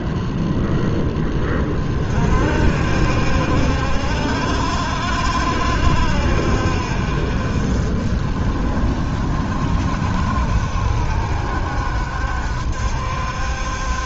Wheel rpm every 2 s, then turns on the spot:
10, 60, 60, 50, 40, 60, 60.
none